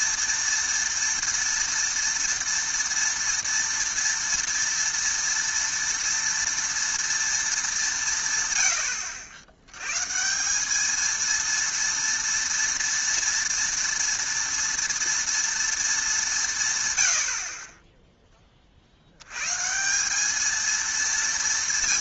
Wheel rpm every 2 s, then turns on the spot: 230, 230, 230, 230, 100, 200, 230, 230, 150, 40, 220.
none